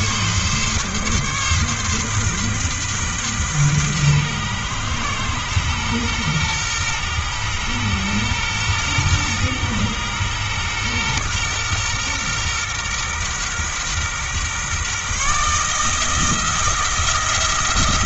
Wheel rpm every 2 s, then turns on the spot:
140, 130, 120, 120, 120, 120, 120, 140, 160.
none